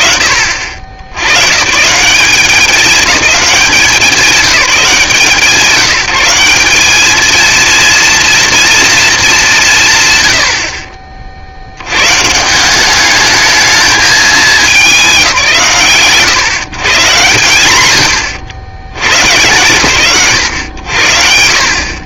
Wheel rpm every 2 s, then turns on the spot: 100, 200, 160, 220, 210, 60, 210, 160, 140, 100, 70.
none